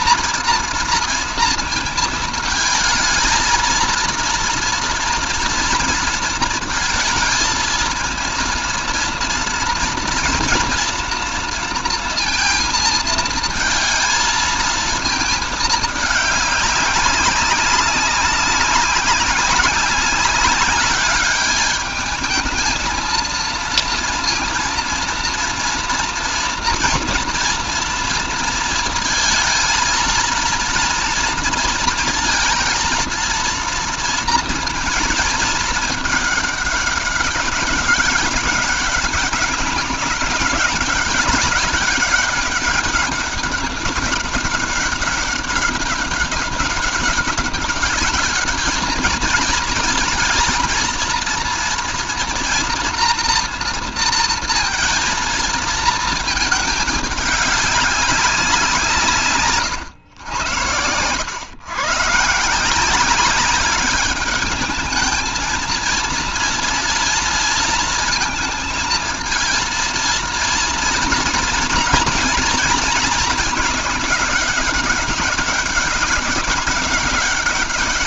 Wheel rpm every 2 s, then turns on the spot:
230, 220, 230, 230, 230, 230, 220, 220, 200, 200, 200, 220, 230, 230, 230, 230, 230, 220, 200, 200, 190, 200, 200, 200, 220, 230, 230, 230, 210, 160, 100, 180, 220, 230, 230, 230, 220, 200, 190.
none